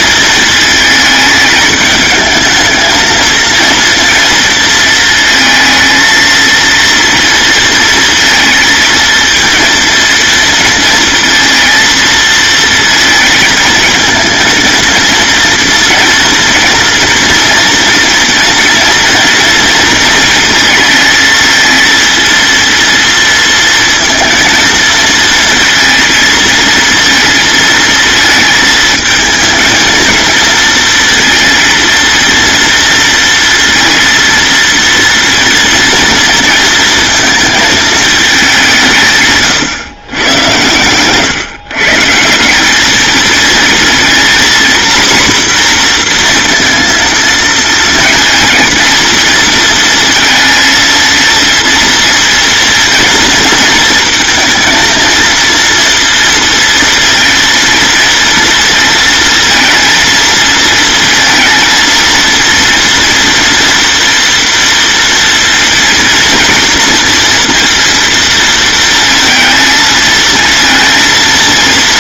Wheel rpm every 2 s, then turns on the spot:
220, 220, 230, 230, 230, 230, 230, 230, 230, 230, 220, 230, 230, 230, 220, 230, 230, 230, 220, 160, 120, 210, 250, 230, 230, 230, 230, 230, 230, 230, 230, 230, 230, 230, 220, 230.
none